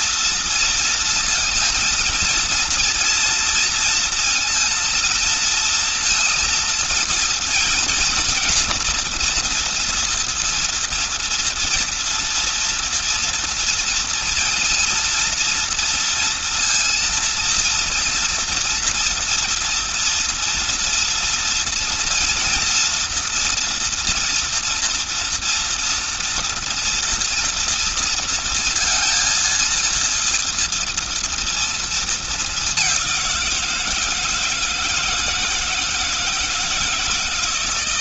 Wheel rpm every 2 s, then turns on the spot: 230, 230, 230, 230, 230, 230, 230, 230, 230, 230, 230, 230, 230, 230, 230, 230, 200, 160, 160.
none